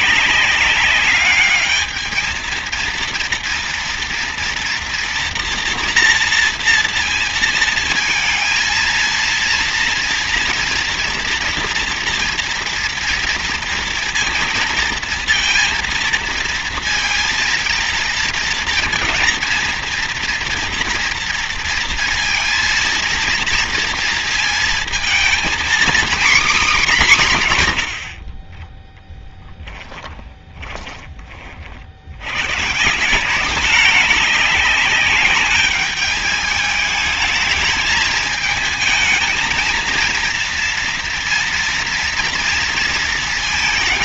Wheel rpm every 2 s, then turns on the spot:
190, 230, 230, 230, 230, 240, 230, 230, 230, 230, 230, 230, 230, 220, 20, 20, 150, 200, 220, 220, 230, 230.
none